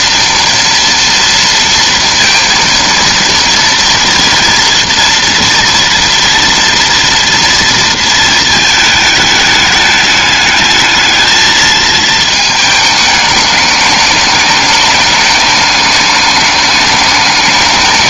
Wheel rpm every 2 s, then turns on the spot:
230, 230, 230, 230, 220, 210, 220, 210, 210.
none